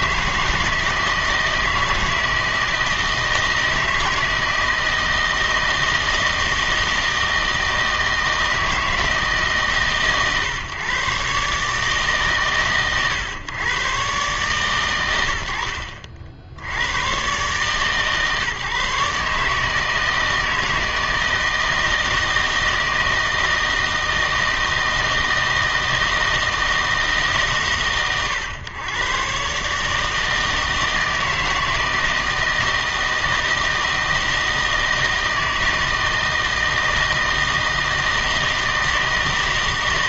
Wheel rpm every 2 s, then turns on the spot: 160, 160, 160, 160, 160, 120, 120, 120, 90, 150, 160, 160, 160, 160, 110, 160, 160, 160, 160, 160.
none